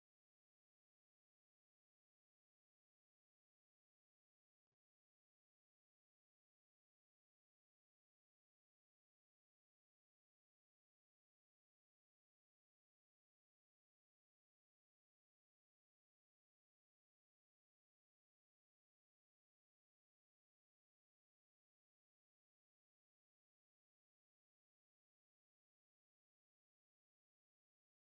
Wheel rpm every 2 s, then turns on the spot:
0, 0, 0, 0, 0, 0, 0, 0, 0, 0, 0, 0, 0, 0.
none